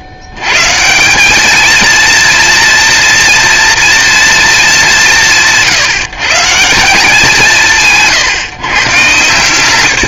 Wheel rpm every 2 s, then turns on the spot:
100, 230, 180, 170, 140.
none